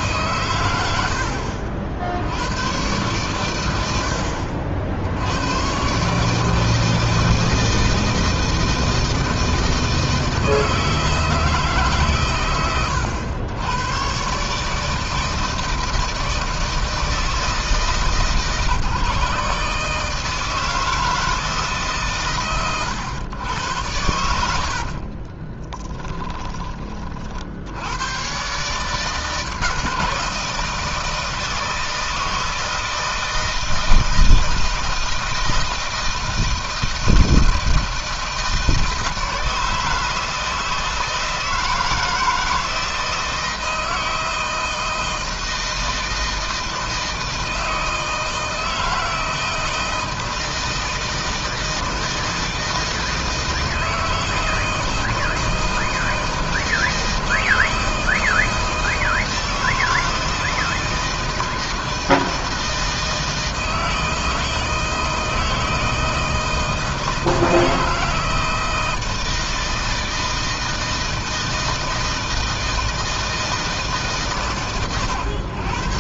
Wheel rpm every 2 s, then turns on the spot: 90, 110, 70, 160, 160, 160, 110, 150, 160, 150, 160, 100, 50, 30, 140, 160, 160, 160, 160, 160, 160, 160, 160, 160, 160, 160, 160, 160, 160, 160, 160, 160, 160, 160, 160, 160, 160, 130.
24-26